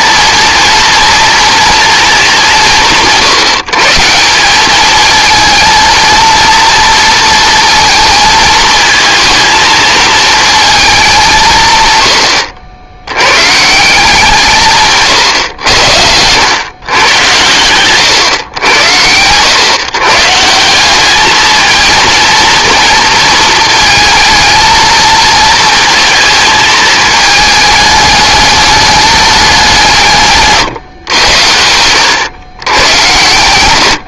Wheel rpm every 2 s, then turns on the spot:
230, 180, 210, 230, 220, 210, 70, 150, 120, 100, 190, 230, 220, 220, 210, 130, 110.
none